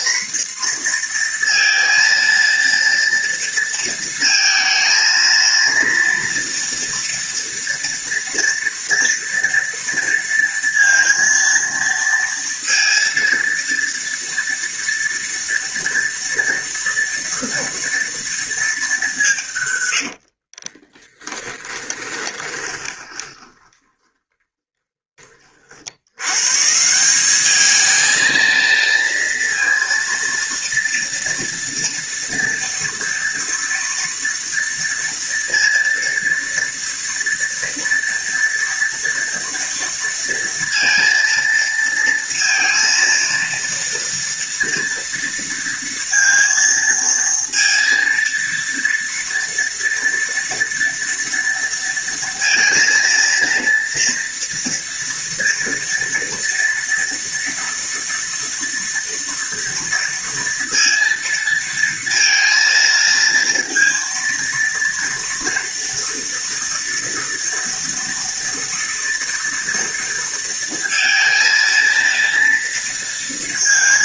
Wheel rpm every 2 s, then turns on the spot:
230, 230, 230, 230, 230, 230, 230, 230, 230, 180, 10, 20, 30, 180, 230, 230, 230, 230, 230, 230, 230, 230, 230, 230, 230, 230, 230, 230, 230, 230, 230, 230, 230, 230, 230, 230, 230.
20-24